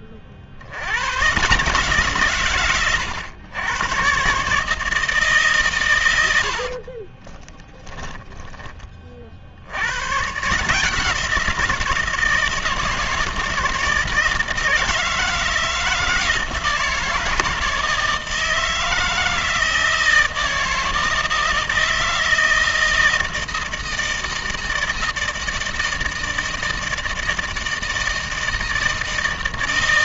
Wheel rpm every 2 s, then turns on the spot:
60, 130, 150, 80, 10, 150, 160, 160, 160, 160, 160, 160, 160, 160, 160.
6-10